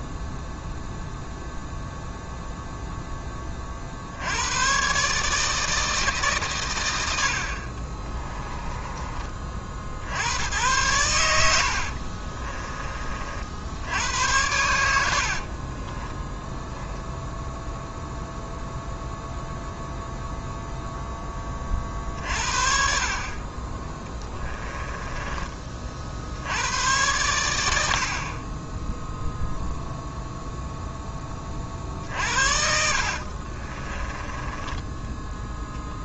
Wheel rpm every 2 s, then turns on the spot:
0, 0, 110, 120, 20, 80, 30, 90, 10, 0, 0, 50, 20, 90, 20, 0, 60, 20.
8-10 12-16 24-26 32-34